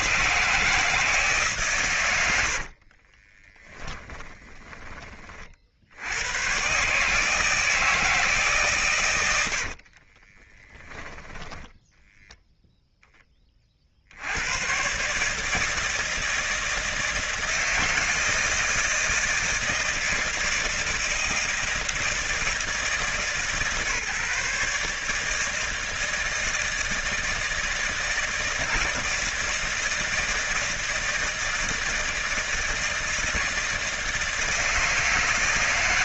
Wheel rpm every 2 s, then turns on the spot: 160, 70, 20, 120, 140, 10, 10, 100, 160, 160, 160, 160, 150, 160, 160, 160, 160, 160.
2-4 10-12